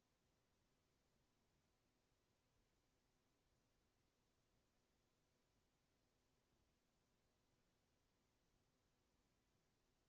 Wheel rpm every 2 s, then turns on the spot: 0, 0, 0, 0, 0.
none